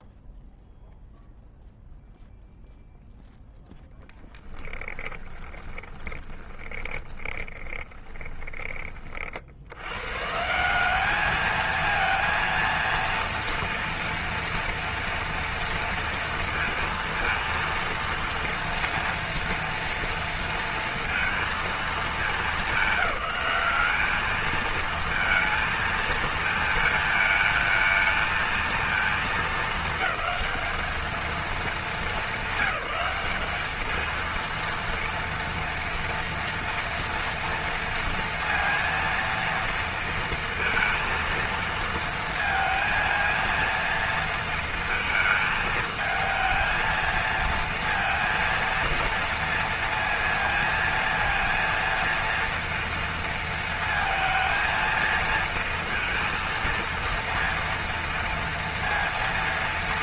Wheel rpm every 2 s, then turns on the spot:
0, 0, 10, 20, 20, 140, 230, 230, 230, 230, 230, 210, 210, 220, 220, 220, 200, 230, 240, 230, 230, 230, 230, 220, 230, 230, 230, 230, 230, 230.
6-10